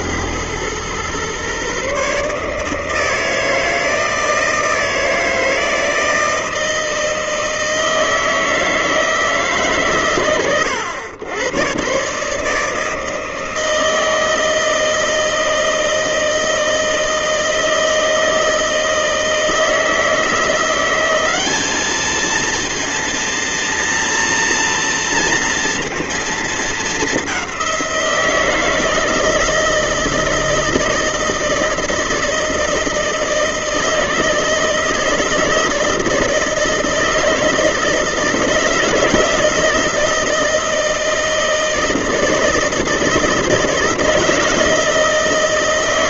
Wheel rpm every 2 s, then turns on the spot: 110, 160, 160, 160, 160, 110, 150, 160, 160, 160, 170, 230, 230, 220, 160, 160, 160, 160, 160, 160, 160, 160, 160.
none